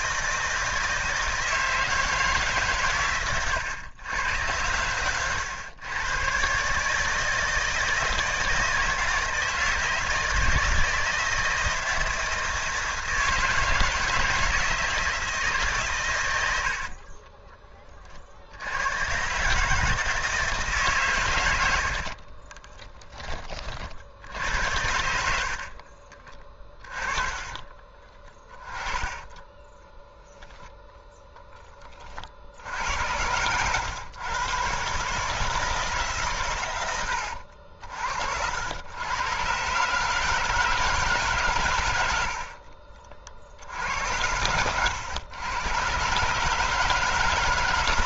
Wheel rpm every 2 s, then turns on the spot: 160, 140, 110, 130, 160, 160, 160, 160, 70, 70, 150, 20, 70, 30, 20, 0, 70, 130, 110, 90, 160, 50, 100, 150.
16-18 22-24 26-30